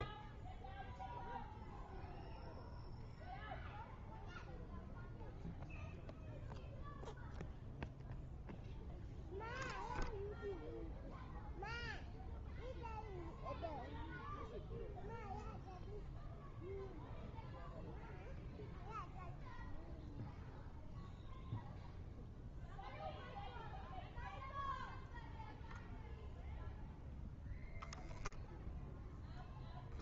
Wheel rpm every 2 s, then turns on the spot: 0, 0, 0, 0, 0, 0, 0, 0, 0, 0, 0, 0, 0, 0, 0.
none